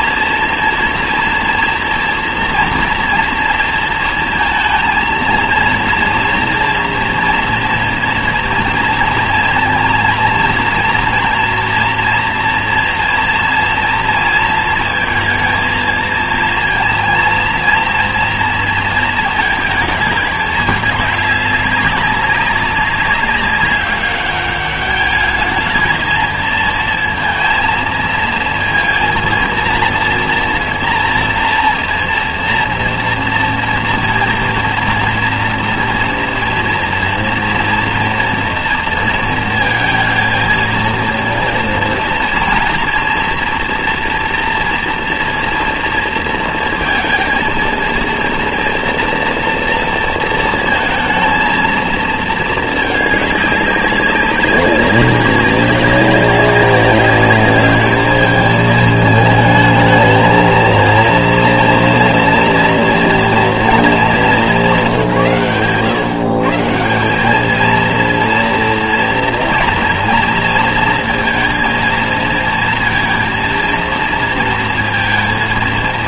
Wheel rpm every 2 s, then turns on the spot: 230, 230, 230, 230, 230, 230, 240, 230, 230, 230, 210, 190, 200, 230, 230, 230, 240, 230, 230, 230, 230, 230, 230, 230, 230, 220, 220, 200, 190, 220, 230, 230, 150, 170, 230, 230, 230, 230.
none